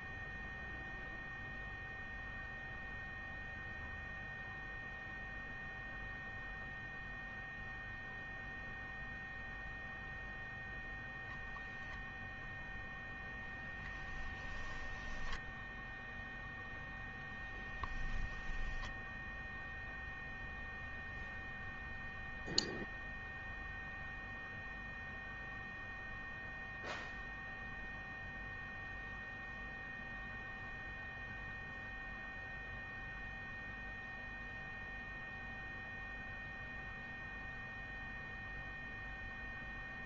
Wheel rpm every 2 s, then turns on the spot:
0, 0, 0, 0, 0, 0, 0, 10, 0, 0, 0, 0, 0, 0, 0, 0, 0, 0, 0, 0.
none